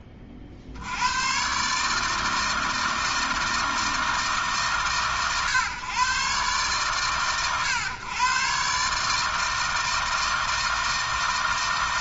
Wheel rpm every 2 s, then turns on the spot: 80, 160, 120, 120, 140, 160.
none